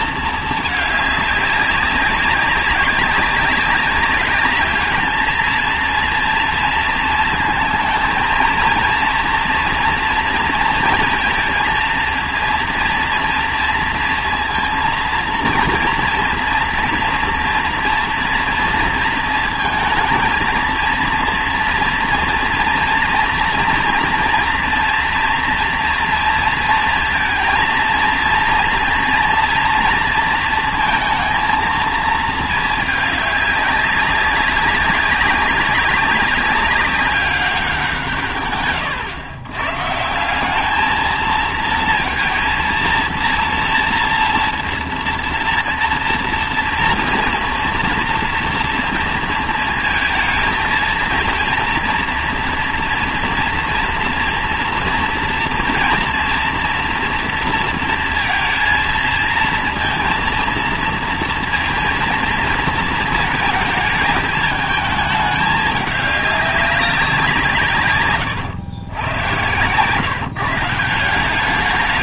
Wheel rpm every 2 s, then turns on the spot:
210, 200, 210, 230, 230, 230, 240, 230, 230, 230, 230, 230, 240, 230, 230, 230, 220, 200, 200, 130, 200, 230, 240, 230, 230, 220, 240, 240, 230, 230, 230, 230, 220, 200, 120, 160.
none